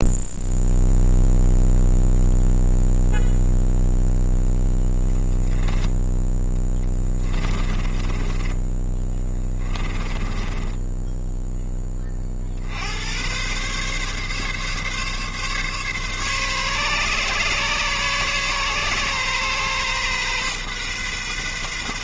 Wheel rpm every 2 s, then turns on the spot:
0, 0, 0, 10, 20, 10, 60, 140, 140, 130, 130.
6-12